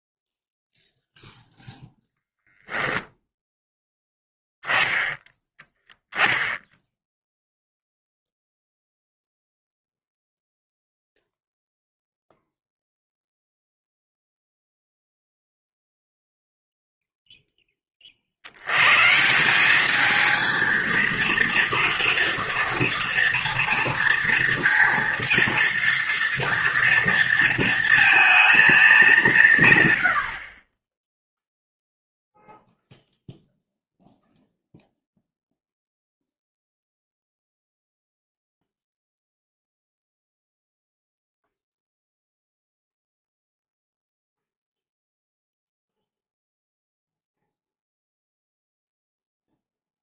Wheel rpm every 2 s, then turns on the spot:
0, 0, 0, 0, 0, 0, 0, 0, 0, 90, 220, 230, 230, 230, 220, 30, 0, 0, 0, 0, 0, 0, 0, 0, 0.
none